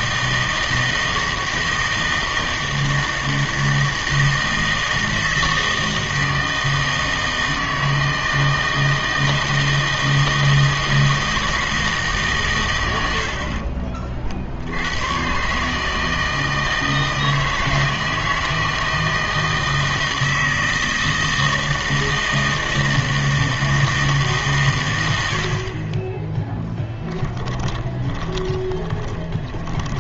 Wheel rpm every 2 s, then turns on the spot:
160, 160, 160, 160, 160, 160, 120, 80, 160, 160, 160, 160, 120, 10, 30.
28-30